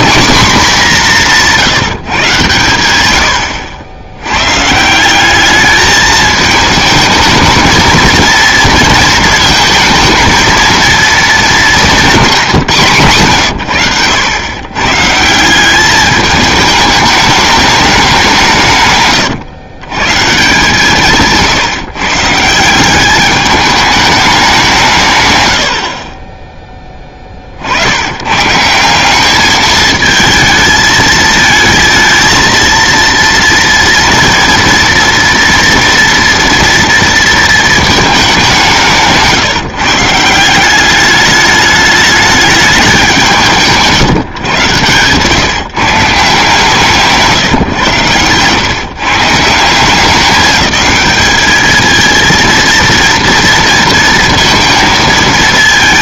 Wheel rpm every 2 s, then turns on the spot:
240, 120, 130, 220, 230, 230, 180, 110, 210, 160, 150, 160, 190, 20, 150, 220, 230, 230, 230, 190, 180, 200, 120, 160, 120, 200, 230, 230.
none